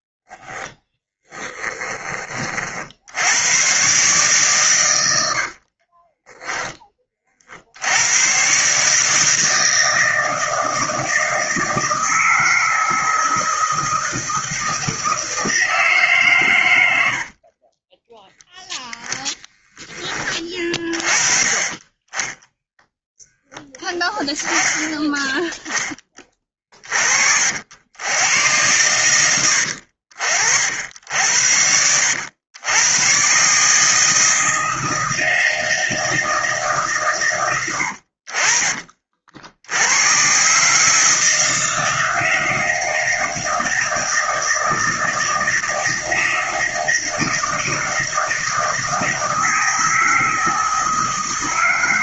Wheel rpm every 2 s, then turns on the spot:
10, 80, 90, 50, 160, 160, 160, 160, 30, 10, 30, 10, 10, 50, 100, 70, 120, 160, 120, 50, 160, 160, 160, 160, 160, 160.
0-2 4-6